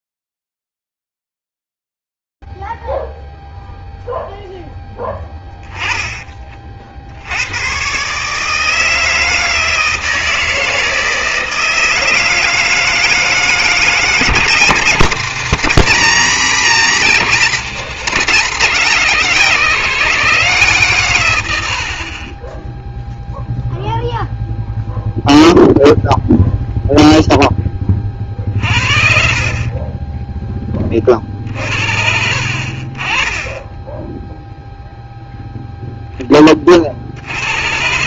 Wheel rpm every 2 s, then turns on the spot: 0, 0, 0, 40, 160, 160, 160, 180, 180, 200, 150, 10, 0, 0, 50, 20, 40, 0, 60.
none